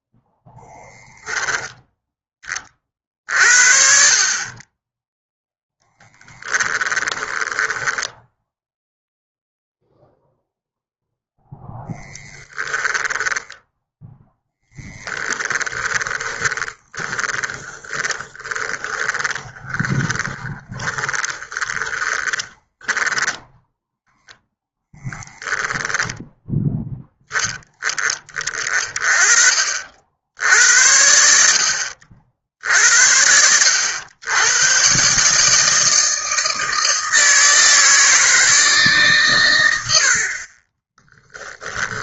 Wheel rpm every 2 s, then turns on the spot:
10, 40, 10, 10, 0, 0, 10, 10, 30, 20, 10, 10, 0, 10, 30, 70, 70, 130, 160, 150, 20.
6-8 12-24 40-42